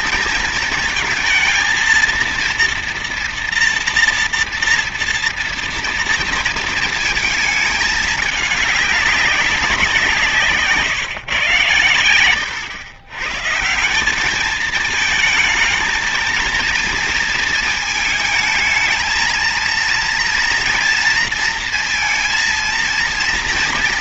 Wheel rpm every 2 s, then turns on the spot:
230, 230, 230, 230, 210, 160, 110, 210, 230, 220, 230, 230.
10-12